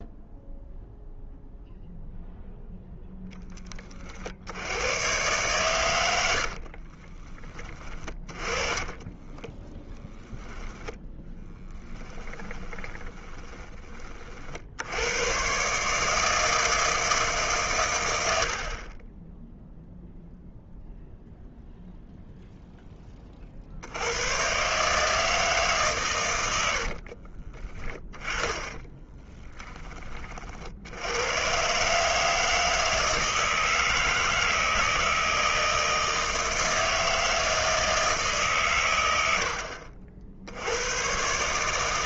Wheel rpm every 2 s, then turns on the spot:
0, 0, 100, 50, 20, 10, 10, 60, 160, 50, 0, 10, 140, 90, 20, 60, 160, 160, 160, 130, 80.
6-14 26-30